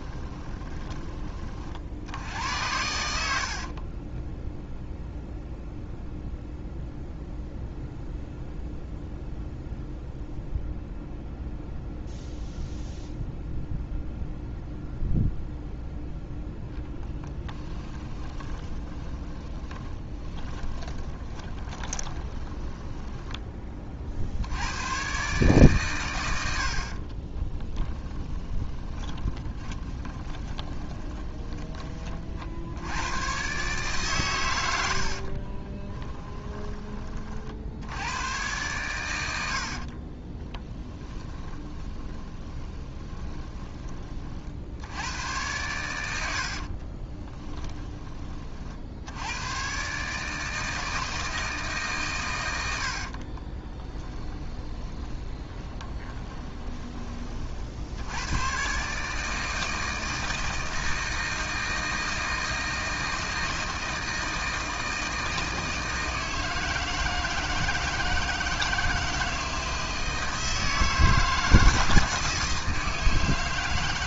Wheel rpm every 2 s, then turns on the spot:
20, 80, 0, 0, 0, 0, 0, 0, 10, 30, 20, 10, 110, 60, 20, 20, 90, 80, 20, 100, 10, 30, 80, 40, 60, 160, 70, 20, 30, 140, 160, 160, 160, 160, 160, 160, 160.
16-24 26-32 34-36 40-44 46-48 52-56